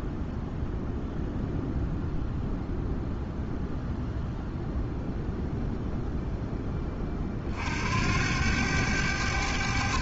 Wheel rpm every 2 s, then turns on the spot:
0, 0, 0, 20, 90.
none